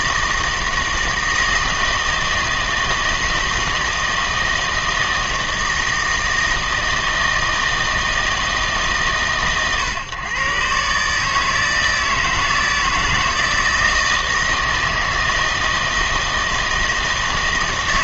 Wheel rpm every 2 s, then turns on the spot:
160, 160, 160, 160, 150, 140, 160, 160, 160.
none